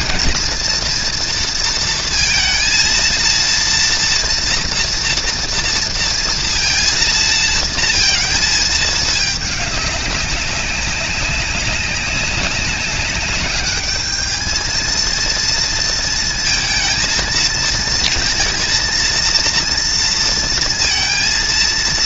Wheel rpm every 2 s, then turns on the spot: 240, 230, 230, 230, 220, 200, 200, 230, 230, 230, 230.
none